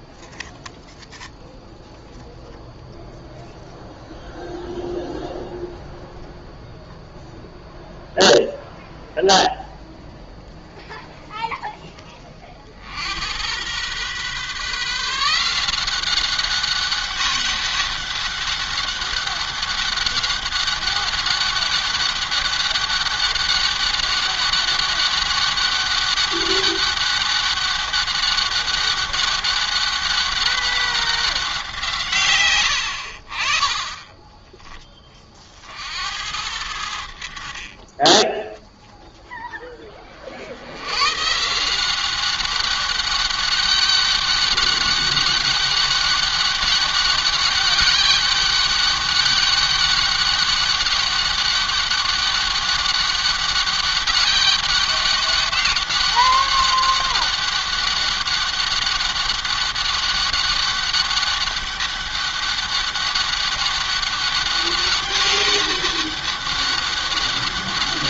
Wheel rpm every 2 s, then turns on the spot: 0, 0, 0, 0, 0, 0, 50, 150, 190, 200, 200, 200, 200, 200, 200, 190, 90, 20, 70, 0, 90, 200, 200, 200, 200, 200, 200, 200, 200, 200, 200, 200, 200, 200.
none